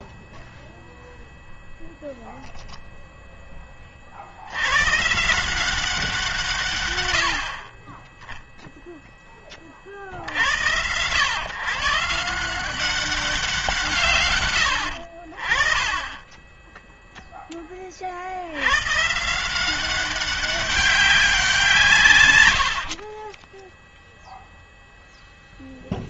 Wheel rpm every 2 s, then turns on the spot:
0, 0, 110, 140, 0, 90, 170, 110, 10, 90, 190, 100, 0.
22-24